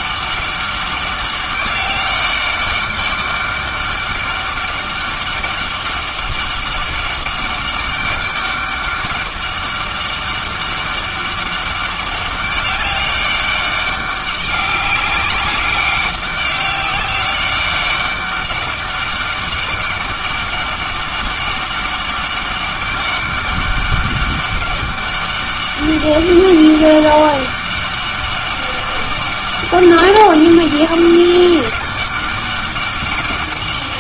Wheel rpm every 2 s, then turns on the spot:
200, 200, 200, 200, 200, 200, 200, 190, 190, 200, 200, 200, 190, 200, 200, 200, 200.
none